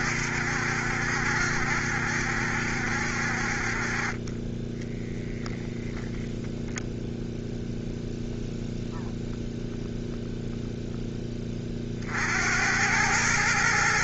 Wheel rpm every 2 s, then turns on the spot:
70, 70, 10, 0, 0, 0, 80.
none